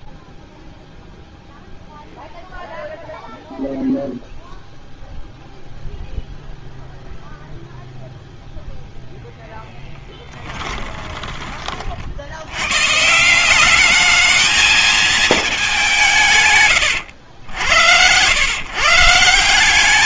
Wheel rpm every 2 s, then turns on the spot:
0, 0, 0, 0, 10, 60, 210, 160, 110, 210.
8-10